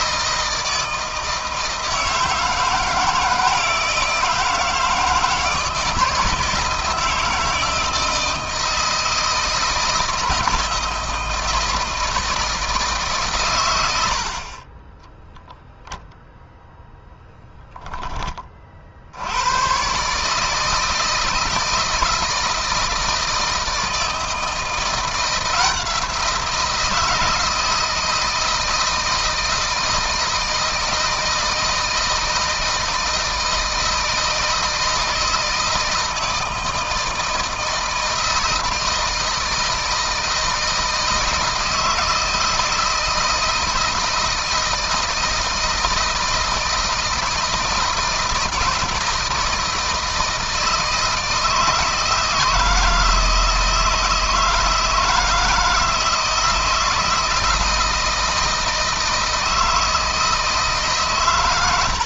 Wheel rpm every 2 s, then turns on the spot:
160, 160, 160, 160, 160, 160, 150, 20, 0, 60, 150, 160, 170, 170, 160, 160, 160, 160, 160, 160, 160, 160, 160, 160, 160, 160, 160, 160, 170, 160, 140.
14-16